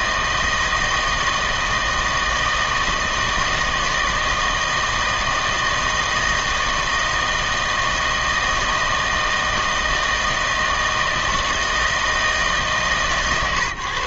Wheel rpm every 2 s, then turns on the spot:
160, 160, 160, 160, 160, 160, 150.
none